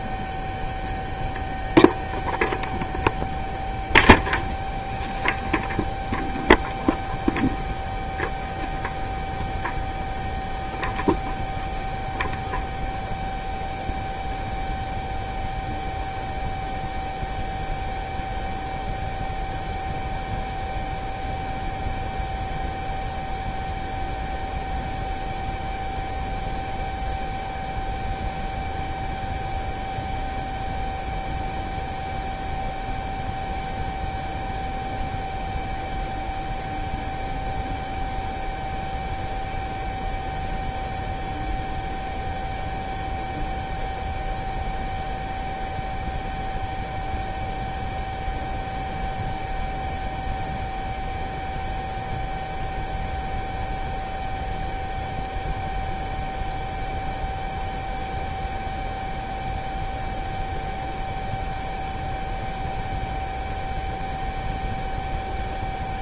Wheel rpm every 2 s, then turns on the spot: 0, 0, 0, 0, 0, 0, 0, 0, 0, 0, 0, 0, 0, 0, 0, 0, 0, 0, 0, 0, 0, 0, 0, 0, 0, 0, 0, 0, 0, 0, 0, 0, 0.
none